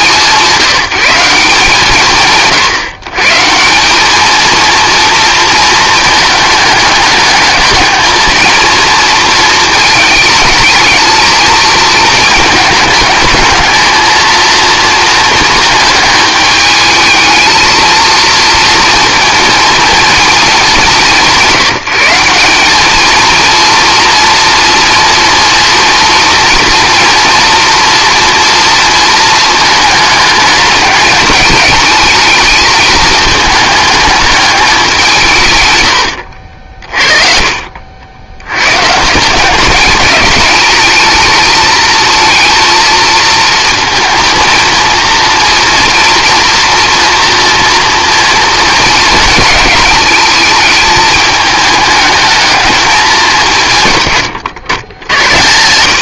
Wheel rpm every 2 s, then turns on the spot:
180, 150, 230, 210, 230, 220, 220, 230, 210, 230, 210, 210, 240, 230, 230, 220, 220, 200, 60, 120, 210, 230, 230, 230, 230, 220, 210, 100.
none